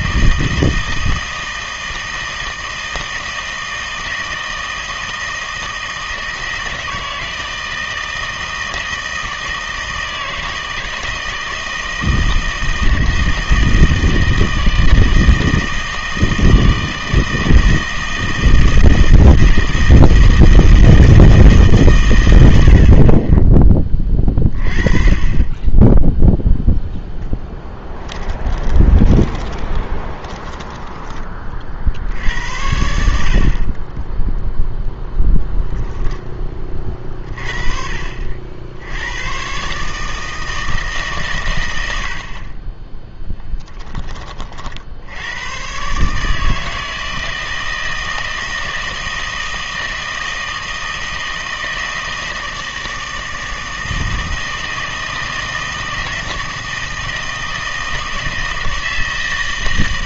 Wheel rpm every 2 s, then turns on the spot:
160, 160, 160, 160, 160, 160, 160, 160, 160, 160, 160, 70, 30, 0, 20, 10, 70, 0, 30, 70, 160, 30, 70, 160, 160, 160, 160, 160, 160, 160.
28-32